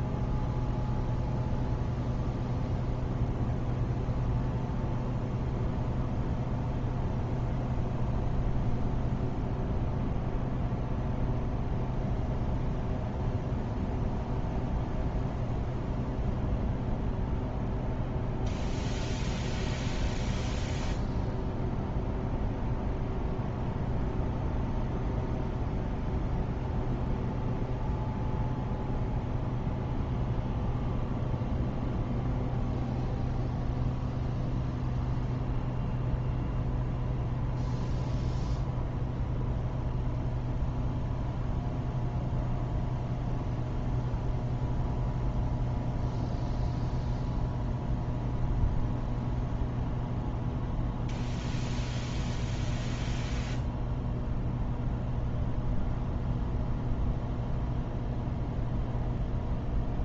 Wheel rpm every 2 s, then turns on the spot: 0, 0, 0, 0, 0, 0, 0, 0, 0, 0, 0, 0, 0, 0, 0, 0, 0, 0, 0, 0, 0, 0, 0, 0, 0, 0, 0, 0, 0, 0.
none